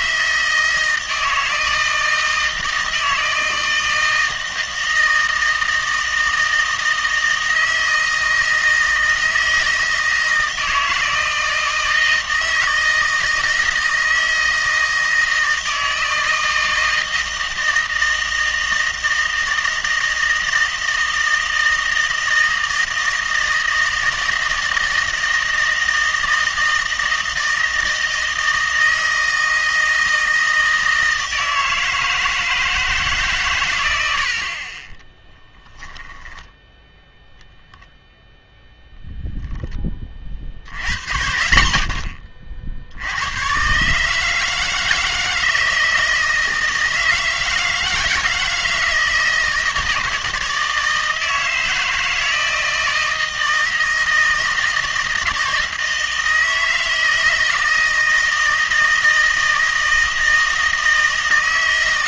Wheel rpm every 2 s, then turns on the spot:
160, 160, 160, 160, 160, 160, 160, 160, 160, 160, 160, 160, 160, 160, 160, 160, 150, 30, 0, 10, 70, 70, 160, 160, 160, 160, 160, 160, 160, 160, 160.
none